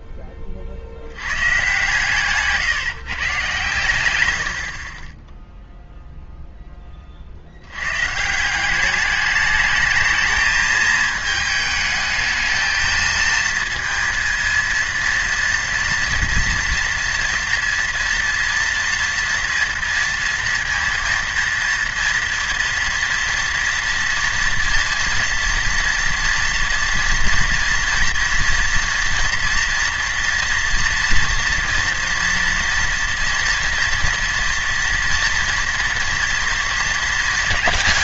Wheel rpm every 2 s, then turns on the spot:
20, 140, 70, 0, 170, 220, 220, 230, 230, 230, 230, 230, 230, 230, 230, 230, 230, 230, 230.
none